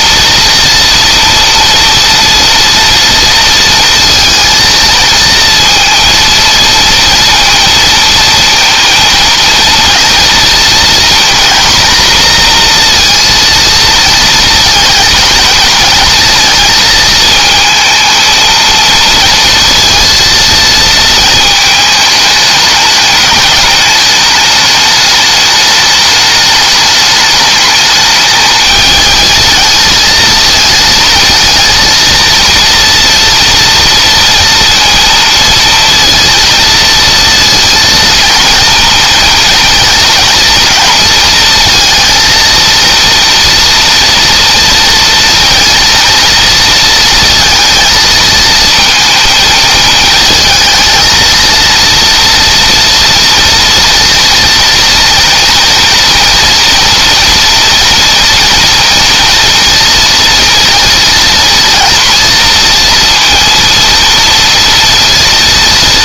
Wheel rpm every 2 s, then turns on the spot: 230, 230, 230, 230, 230, 240, 240, 220, 220, 230, 220, 210, 210, 210, 220, 230, 230, 230, 230, 230, 220, 230, 230, 230, 230, 220, 230, 240, 230, 230, 230, 230, 230.
none